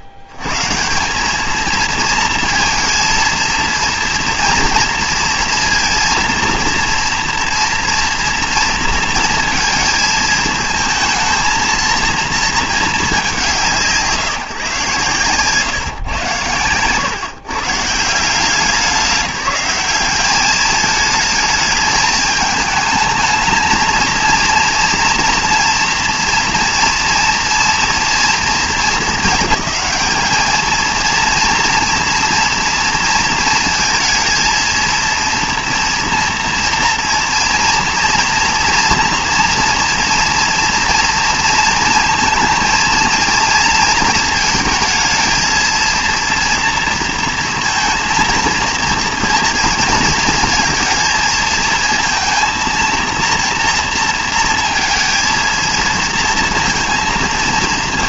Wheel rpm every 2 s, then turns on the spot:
70, 230, 230, 230, 230, 220, 230, 140, 110, 170, 210, 220, 230, 230, 230, 220, 230, 230, 230, 230, 230, 230, 220, 230, 230, 230, 230, 230, 230.
none